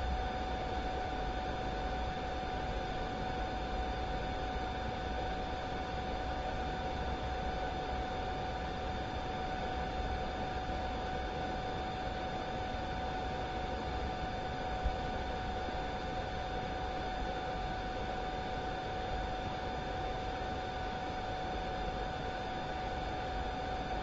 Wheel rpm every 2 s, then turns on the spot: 0, 0, 0, 0, 0, 0, 0, 0, 0, 0, 0, 0.
none